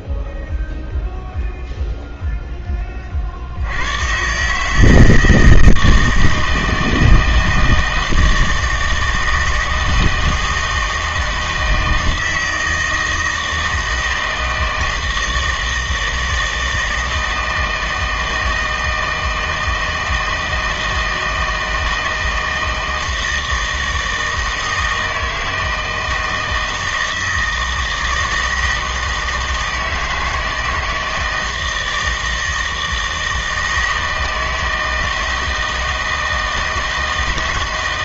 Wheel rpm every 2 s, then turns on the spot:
0, 30, 160, 160, 160, 160, 160, 160, 160, 160, 160, 160, 160, 160, 160, 160, 160, 160, 160.
none